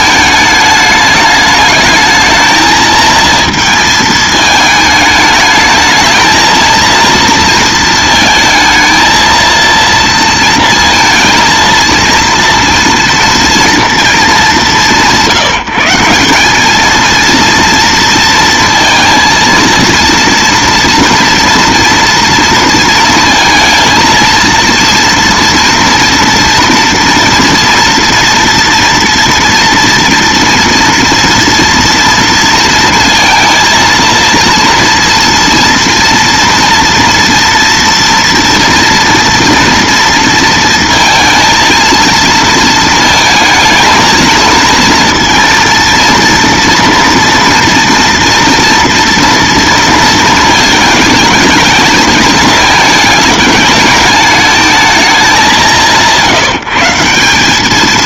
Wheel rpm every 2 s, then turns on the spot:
210, 220, 220, 230, 220, 230, 230, 180, 210, 230, 230, 230, 230, 230, 230, 230, 230, 230, 230, 230, 230, 230, 230, 230, 230, 220, 220, 210, 160.
none